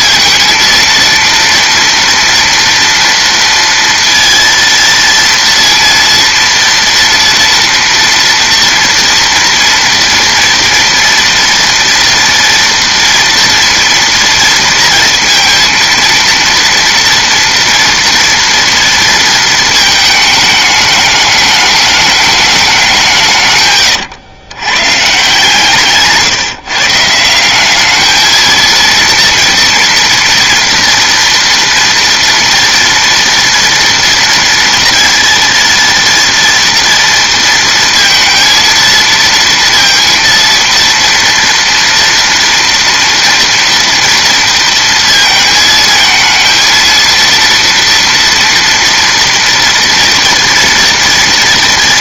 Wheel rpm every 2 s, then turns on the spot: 230, 230, 230, 230, 240, 230, 230, 230, 230, 230, 220, 190, 120, 150, 230, 230, 230, 230, 230, 230, 230, 230, 230, 230, 230, 230.
none